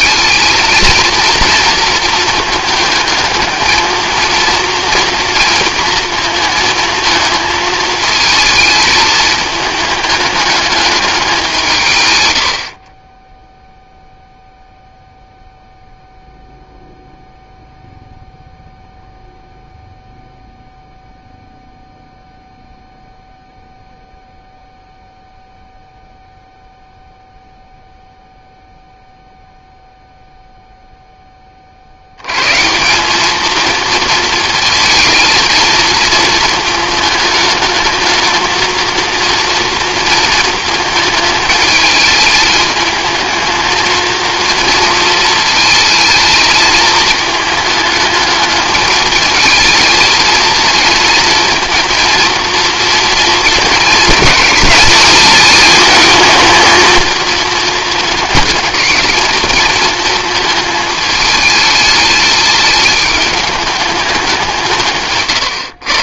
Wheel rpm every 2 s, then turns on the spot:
230, 220, 230, 220, 220, 210, 50, 0, 0, 0, 0, 0, 0, 0, 0, 0, 150, 230, 220, 220, 220, 220, 230, 220, 210, 230, 230, 220, 220, 220, 220, 210, 170.
none